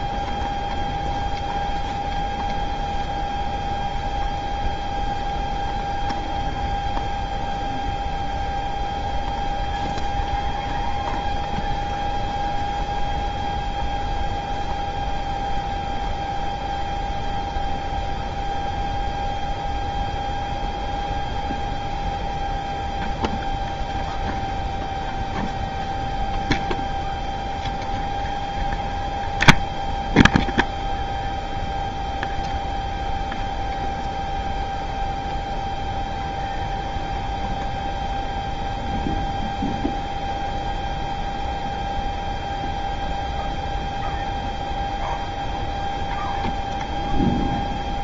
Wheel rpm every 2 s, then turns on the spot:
0, 0, 0, 0, 0, 0, 0, 0, 0, 0, 0, 0, 0, 0, 0, 0, 0, 0, 0, 0, 0, 0, 0, 0.
none